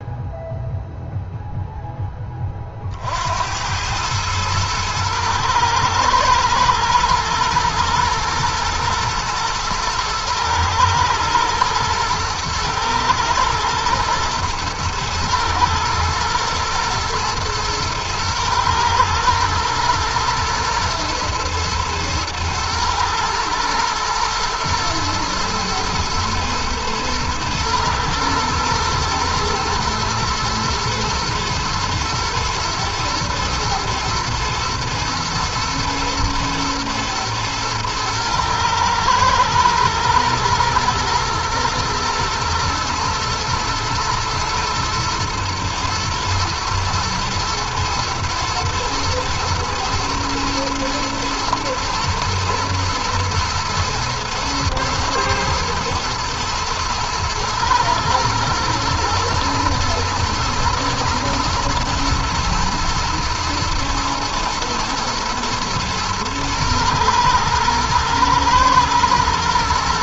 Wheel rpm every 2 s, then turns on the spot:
0, 60, 110, 120, 110, 110, 110, 110, 120, 110, 120, 120, 110, 110, 120, 110, 110, 110, 110, 110, 120, 120, 120, 120, 110, 110, 110, 120, 110, 110, 110, 110, 110, 120, 120.
none